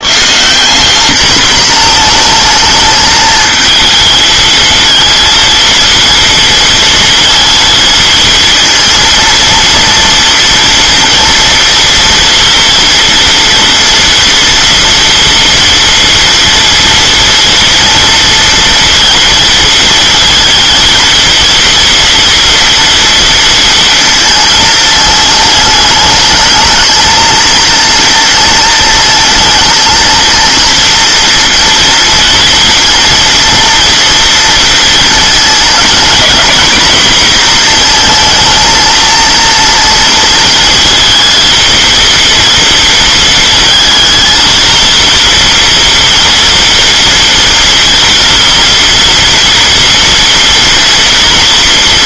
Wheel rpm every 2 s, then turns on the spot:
180, 220, 220, 230, 230, 230, 230, 230, 230, 230, 230, 230, 220, 220, 230, 230, 230, 230, 250, 230, 230, 230, 230, 230, 230, 230.
none